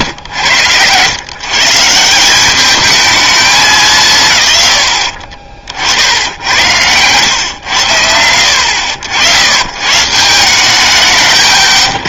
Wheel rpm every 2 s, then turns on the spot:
100, 200, 120, 90, 70, 160.
none